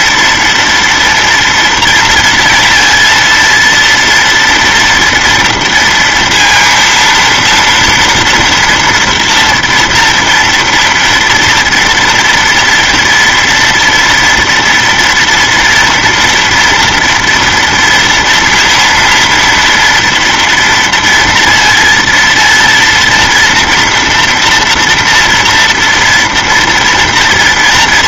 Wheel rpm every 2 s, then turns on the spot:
230, 230, 230, 230, 230, 230, 230, 230, 230, 230, 230, 230, 240, 230.
none